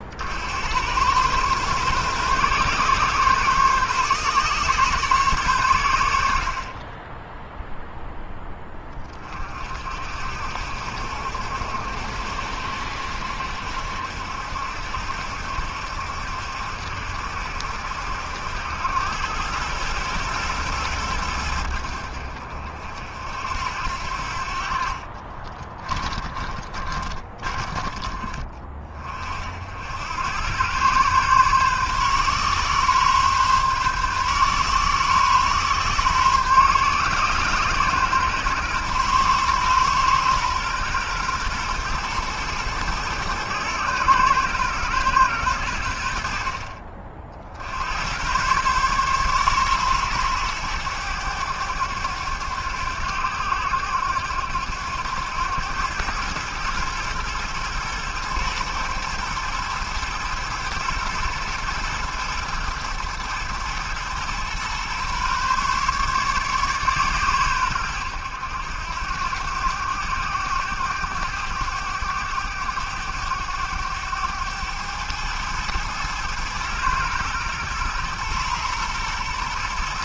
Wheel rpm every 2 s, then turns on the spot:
90, 130, 130, 20, 30, 70, 70, 70, 70, 100, 110, 60, 50, 30, 40, 120, 140, 130, 130, 120, 120, 110, 110, 50, 130, 100, 90, 90, 110, 110, 120, 110, 130, 130, 90, 100, 100, 110, 120, 120.
24-28